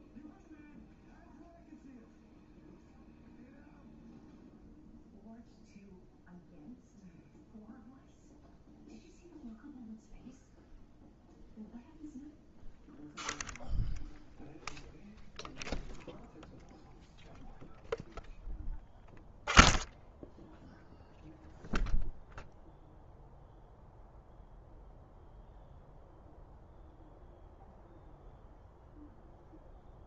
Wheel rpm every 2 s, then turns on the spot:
0, 0, 0, 0, 0, 0, 0, 0, 0, 0, 0, 0, 0, 0, 0.
none